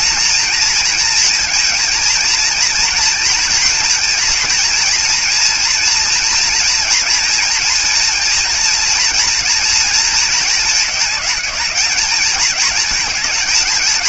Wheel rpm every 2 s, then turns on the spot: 240, 230, 230, 230, 230, 220, 220.
none